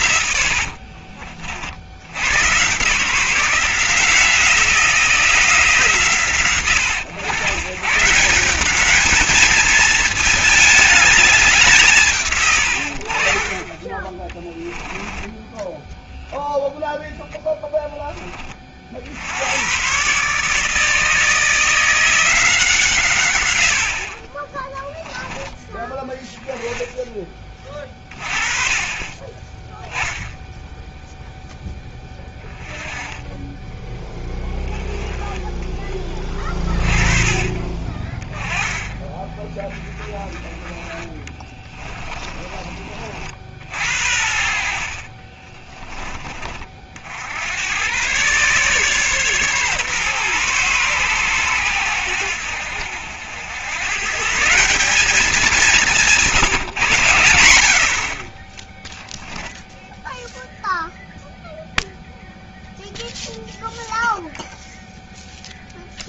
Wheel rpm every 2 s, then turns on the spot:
50, 140, 170, 110, 210, 210, 70, 20, 0, 50, 150, 150, 10, 10, 30, 0, 10, 10, 20, 10, 30, 40, 50, 50, 140, 120, 70, 190, 130, 0, 0, 0, 0.
0-2 14-16 32-34 40-42